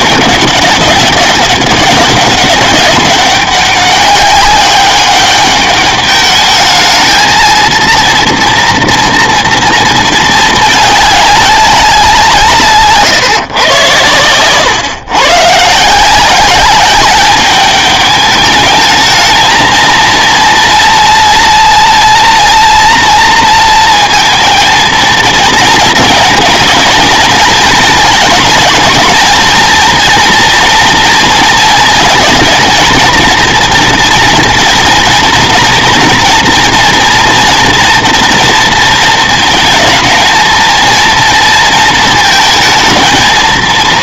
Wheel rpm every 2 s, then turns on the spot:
190, 200, 200, 210, 230, 220, 150, 120, 190, 210, 230, 240, 230, 230, 210, 230, 220, 230, 230, 230, 230, 230.
none